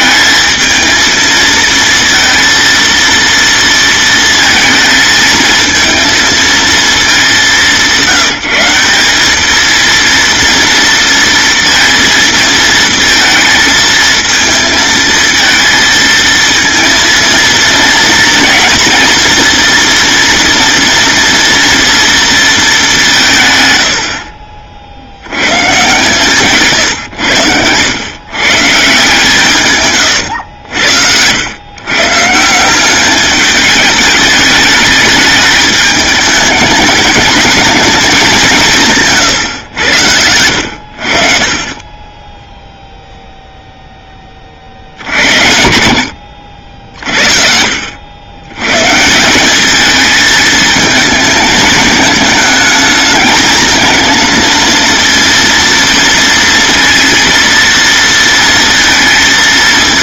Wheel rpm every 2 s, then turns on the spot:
220, 230, 220, 210, 190, 230, 230, 230, 230, 240, 230, 190, 50, 130, 150, 80, 200, 210, 210, 160, 60, 0, 60, 50, 150, 220, 220, 230, 230, 230.
none